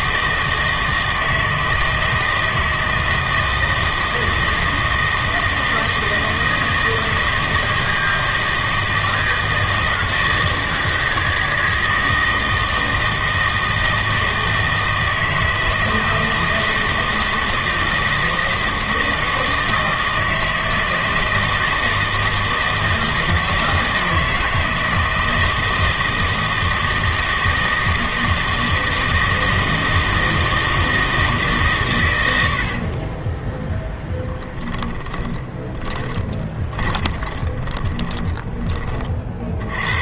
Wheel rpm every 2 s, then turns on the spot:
160, 160, 160, 160, 160, 160, 160, 160, 160, 160, 160, 160, 160, 160, 160, 160, 60, 10, 20, 20.
34-38